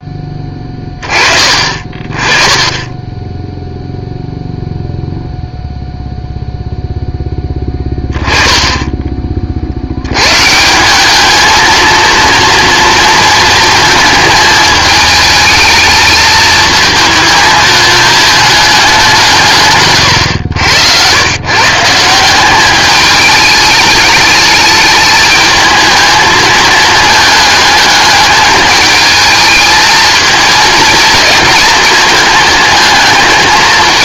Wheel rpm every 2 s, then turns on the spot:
20, 20, 0, 0, 20, 170, 230, 220, 220, 200, 90, 200, 210, 220, 210, 220, 220.
none